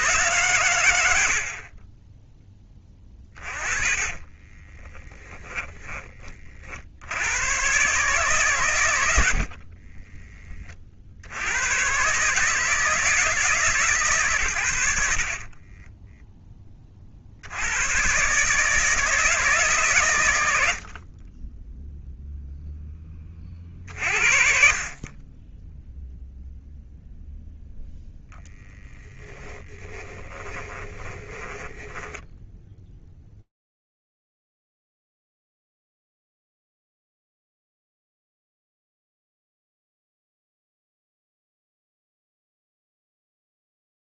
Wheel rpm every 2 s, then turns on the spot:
100, 20, 20, 80, 100, 40, 160, 70, 50, 160, 30, 10, 20, 0, 20, 20, 0, 0, 0, 10, 0, 0.
4-6 8-10 14-16 28-32 38-40